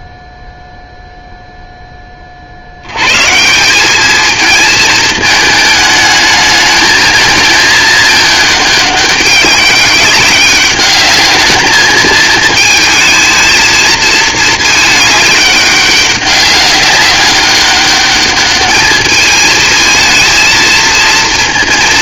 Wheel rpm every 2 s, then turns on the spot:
0, 60, 230, 220, 210, 200, 220, 220, 200, 210, 220.
none